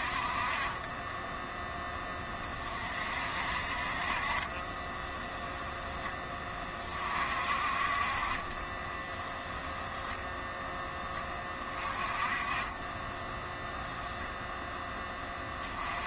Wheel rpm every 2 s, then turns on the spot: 30, 40, 20, 40, 20, 10, 20, 10.
4-6